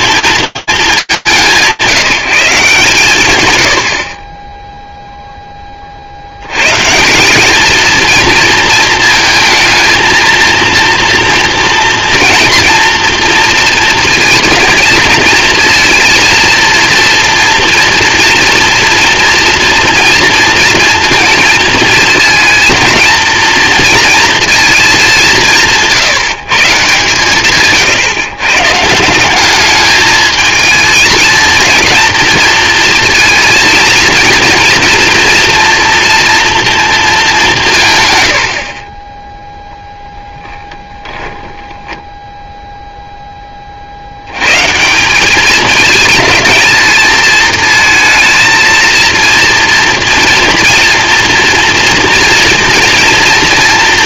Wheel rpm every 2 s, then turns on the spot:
220, 160, 20, 120, 230, 230, 240, 230, 230, 230, 230, 230, 220, 140, 140, 220, 230, 230, 230, 40, 10, 10, 190, 220, 230, 230, 230.
38-42